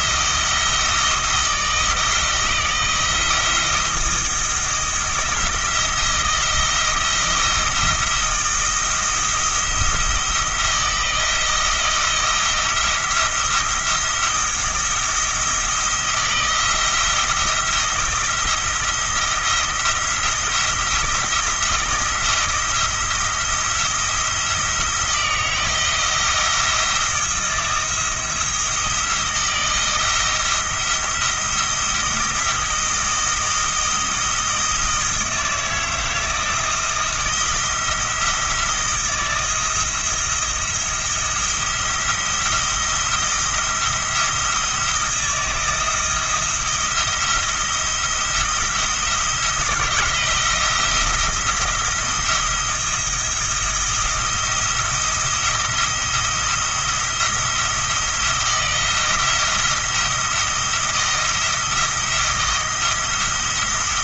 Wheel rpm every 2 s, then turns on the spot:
160, 160, 160, 170, 170, 170, 170, 170, 170, 170, 170, 170, 170, 170, 160, 170, 170, 160, 170, 170, 170, 170, 170, 170, 170, 170, 170, 170, 170, 170, 170, 170.
none